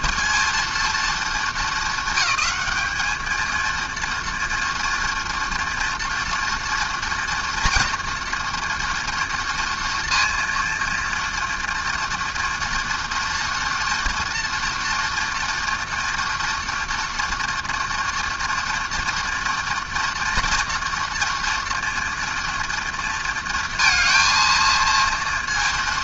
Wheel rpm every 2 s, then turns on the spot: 230, 220, 230, 230, 230, 230, 230, 230, 230, 230, 230, 230, 230.
none